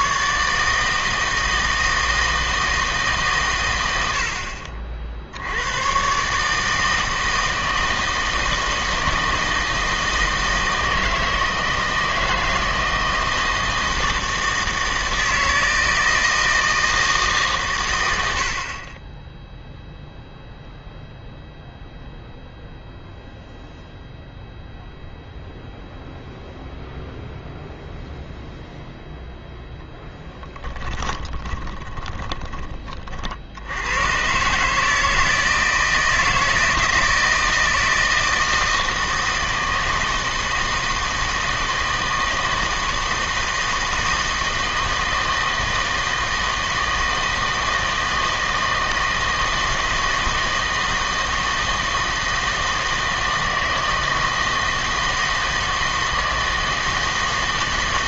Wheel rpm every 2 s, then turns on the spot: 150, 160, 50, 160, 160, 160, 160, 160, 160, 30, 0, 0, 0, 0, 0, 20, 30, 150, 160, 160, 160, 160, 160, 160, 160, 160, 160, 160, 160.
30-32